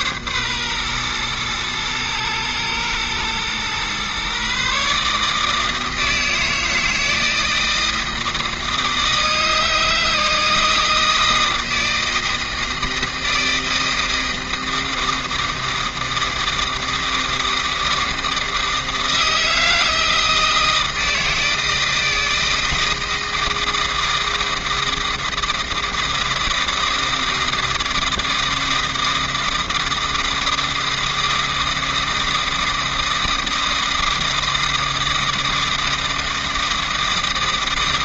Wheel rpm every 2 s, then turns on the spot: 120, 110, 150, 160, 160, 160, 160, 160, 160, 160, 160, 160, 160, 160, 160, 160, 160, 160, 160.
none